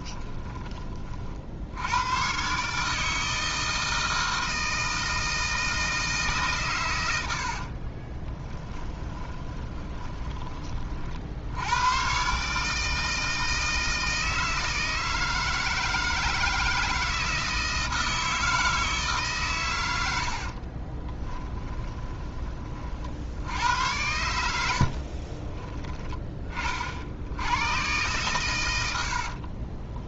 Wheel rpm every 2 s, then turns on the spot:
30, 150, 160, 110, 10, 40, 150, 160, 160, 160, 40, 30, 70, 40, 90.
8-10 20-22 24-26